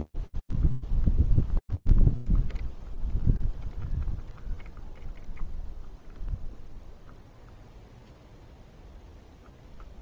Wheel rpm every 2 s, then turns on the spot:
0, 0, 0, 0, 0.
none